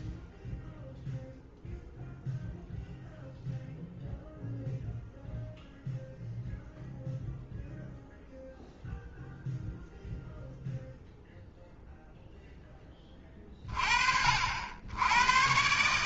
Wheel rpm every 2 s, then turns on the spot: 0, 0, 0, 0, 0, 0, 10, 70.
none